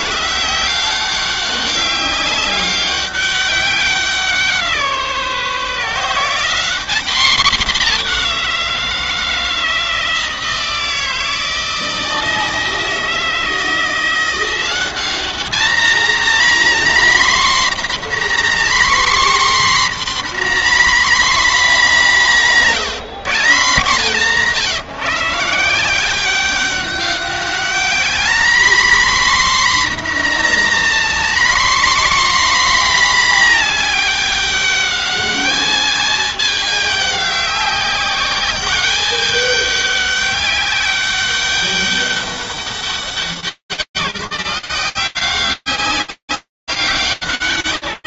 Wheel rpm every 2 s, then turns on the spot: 60, 190, 190, 160, 200, 160, 160, 160, 210, 250, 260, 240, 150, 150, 200, 240, 250, 230, 210, 200, 200, 200, 190, 190.
none